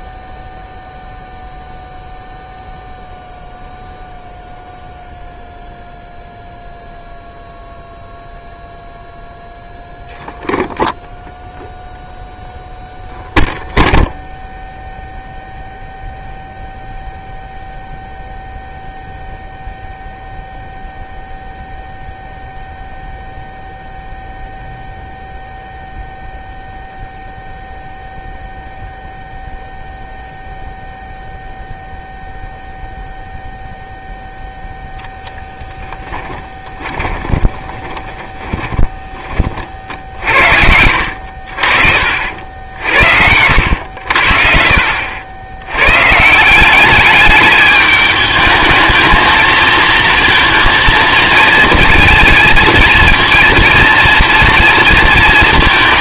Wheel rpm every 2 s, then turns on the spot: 0, 0, 0, 0, 0, 0, 0, 0, 0, 0, 0, 0, 0, 0, 0, 0, 0, 0, 20, 20, 70, 70, 50, 180, 220, 230, 220, 230.
36-44